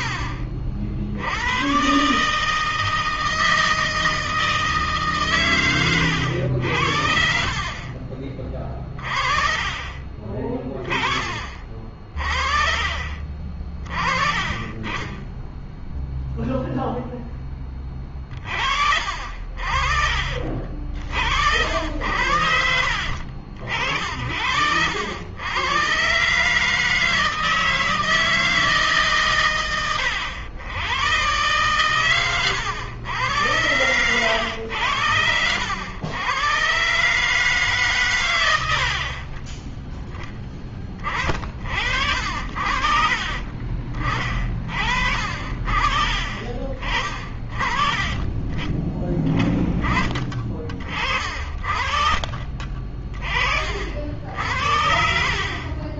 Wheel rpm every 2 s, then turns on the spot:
60, 160, 150, 70, 40, 20, 30, 20, 0, 50, 60, 60, 80, 150, 150, 100, 100, 100, 130, 90, 30, 40, 40, 40, 30, 40, 30, 70.
20-22 38-40 42-44 54-56